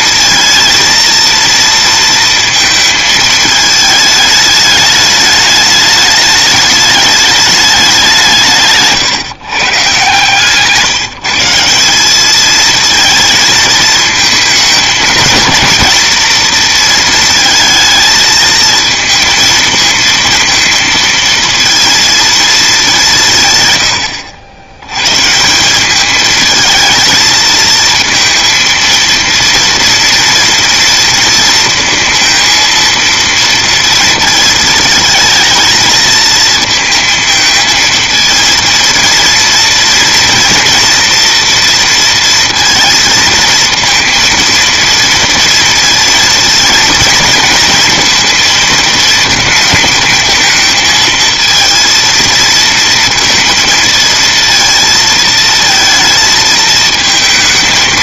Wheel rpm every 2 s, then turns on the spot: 230, 220, 210, 210, 150, 150, 220, 220, 230, 220, 230, 220, 80, 220, 230, 230, 230, 220, 220, 230, 230, 230, 230, 230, 230, 220, 230, 230, 220.
none